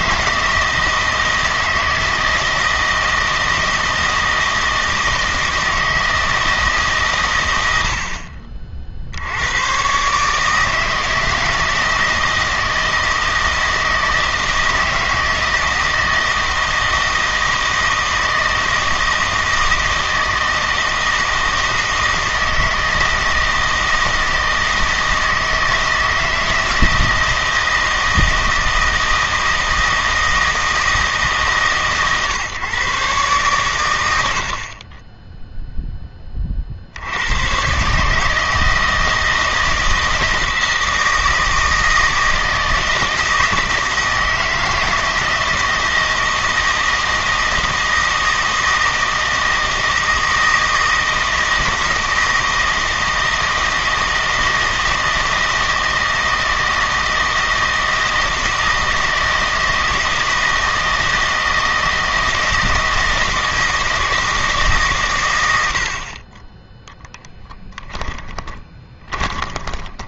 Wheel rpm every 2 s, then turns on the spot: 160, 160, 160, 150, 50, 150, 160, 160, 160, 160, 160, 160, 160, 160, 160, 160, 140, 40, 50, 160, 160, 160, 160, 160, 160, 160, 160, 160, 160, 160, 160, 160, 150, 10, 20.
68-70